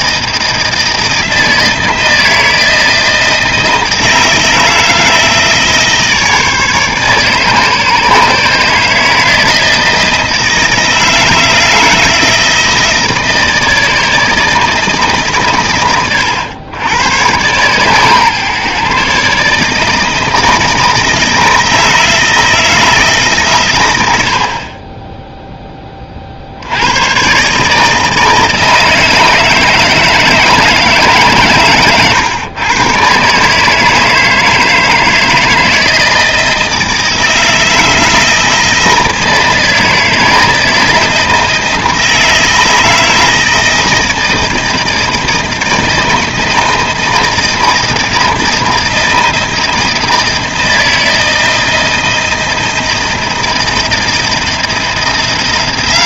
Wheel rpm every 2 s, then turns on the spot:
160, 160, 160, 150, 150, 160, 160, 160, 100, 140, 160, 160, 30, 90, 160, 160, 120, 160, 160, 160, 160, 160, 160, 160, 160, 160, 170, 170.
none